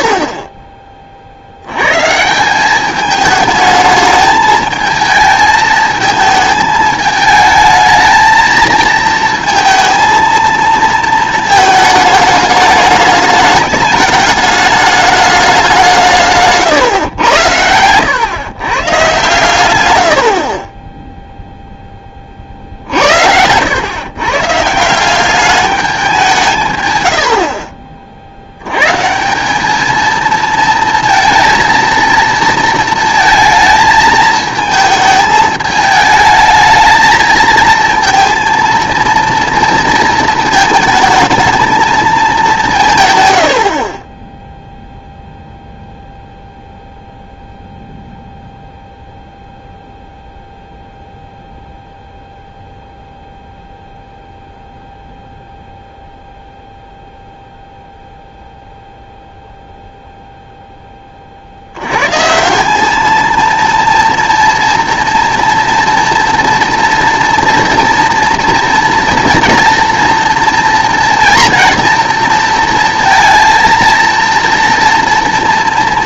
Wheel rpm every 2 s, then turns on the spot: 20, 190, 220, 220, 220, 230, 210, 210, 130, 120, 20, 60, 150, 130, 120, 230, 230, 220, 220, 230, 220, 180, 0, 0, 0, 0, 0, 0, 0, 0, 10, 200, 230, 230, 230, 230, 230, 230.
none